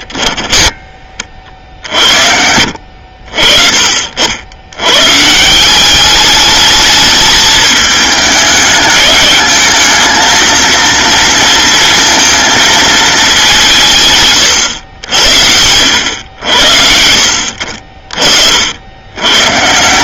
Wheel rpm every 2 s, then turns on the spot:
40, 60, 140, 210, 210, 230, 210, 80, 70, 90.
none